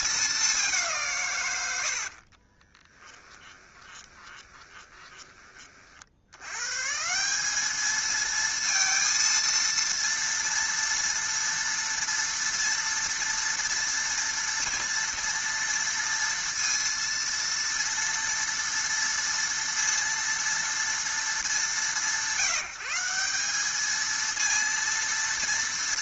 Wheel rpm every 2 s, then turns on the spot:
190, 30, 20, 130, 230, 230, 240, 240, 230, 230, 230, 170, 230.
2-6